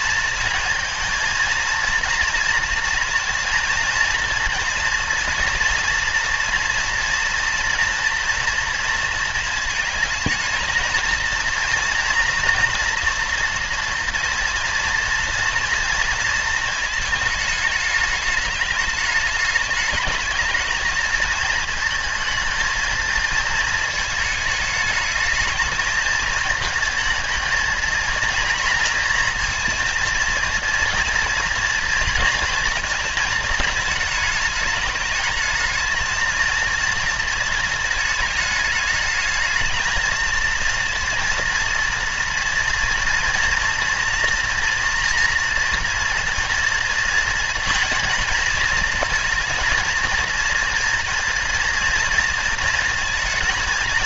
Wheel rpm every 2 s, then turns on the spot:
230, 230, 230, 230, 230, 220, 230, 230, 230, 210, 220, 220, 210, 230, 240, 230, 230, 210, 220, 210, 230, 230, 230, 230, 230, 230, 220.
none